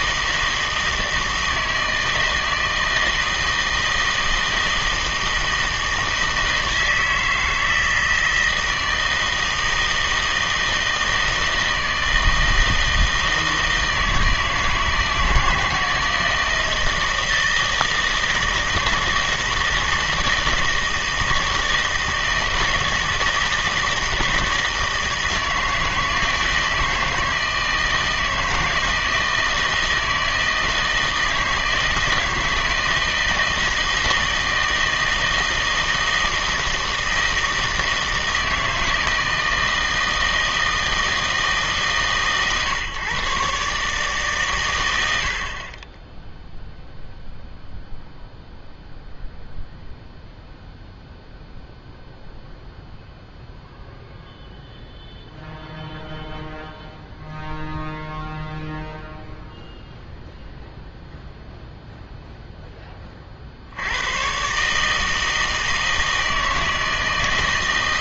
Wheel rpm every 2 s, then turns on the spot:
160, 160, 160, 160, 160, 160, 160, 160, 160, 160, 160, 160, 160, 160, 160, 160, 160, 160, 160, 160, 160, 120, 120, 0, 0, 0, 0, 0, 0, 0, 0, 0, 130, 160.
none